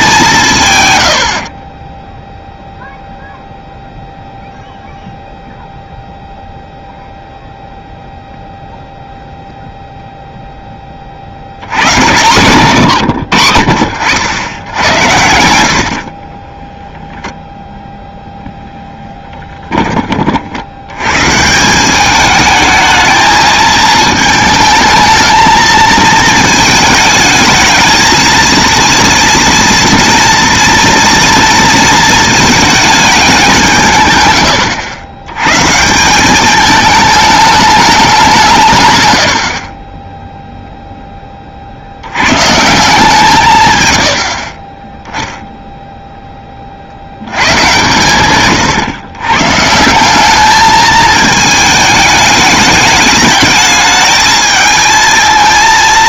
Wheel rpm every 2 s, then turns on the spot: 120, 0, 0, 0, 0, 20, 140, 90, 0, 10, 90, 220, 220, 220, 230, 230, 220, 90, 210, 120, 0, 160, 10, 70, 120, 220, 210, 220.
none